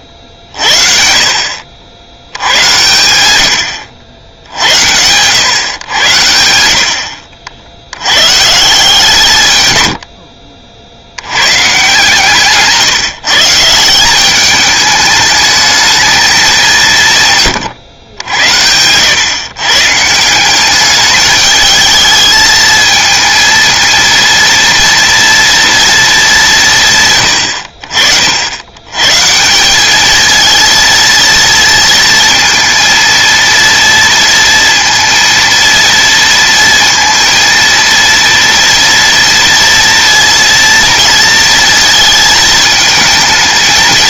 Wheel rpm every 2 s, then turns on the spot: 50, 100, 70, 80, 150, 50, 150, 210, 180, 90, 190, 220, 230, 150, 100, 230, 230, 230, 230, 230, 230, 220.
none